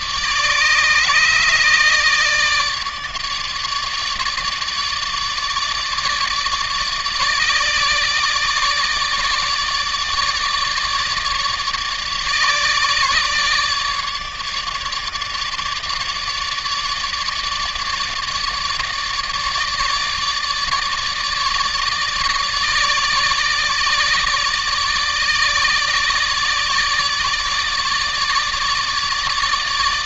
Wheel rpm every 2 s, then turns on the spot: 150, 150, 150, 150, 150, 150, 150, 150, 150, 150, 150, 150, 150, 150, 150.
none